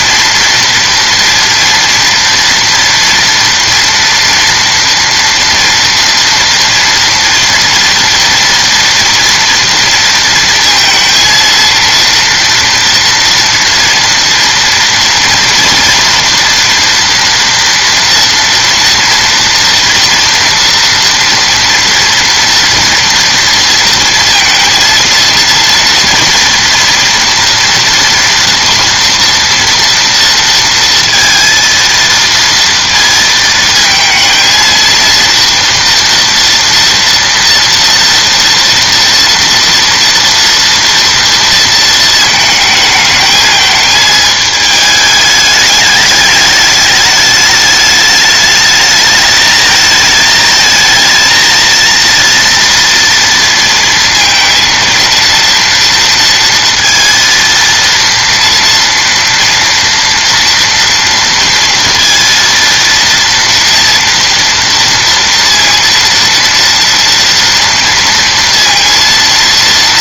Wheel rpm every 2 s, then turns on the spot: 230, 230, 230, 230, 230, 230, 230, 230, 230, 230, 230, 240, 230, 230, 240, 230, 230, 230, 230, 230, 230, 220, 220, 210, 210, 220, 230, 230, 230, 230, 230, 230, 230, 230, 230.
none